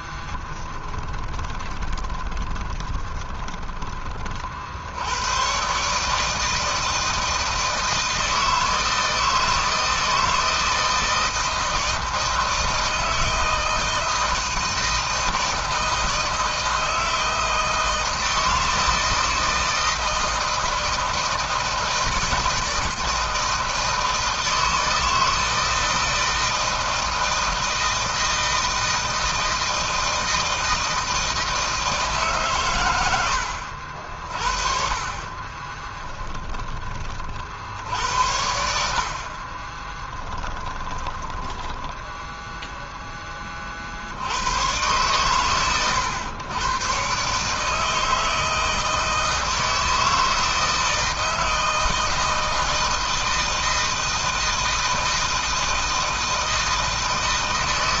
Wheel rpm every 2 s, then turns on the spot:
20, 20, 110, 160, 160, 160, 160, 160, 160, 160, 160, 160, 160, 160, 160, 160, 90, 40, 40, 70, 10, 20, 130, 140, 160, 160, 160, 160, 160.
0-4 34-36 38-42